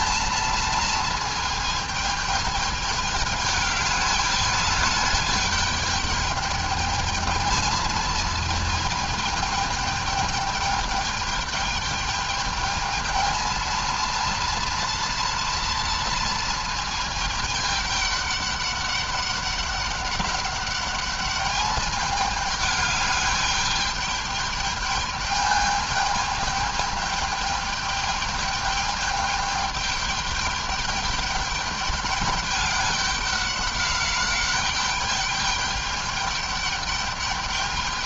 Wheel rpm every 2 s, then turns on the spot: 230, 220, 210, 220, 220, 210, 210, 230, 230, 200, 200, 210, 210, 210, 210, 210, 200, 200, 210.
none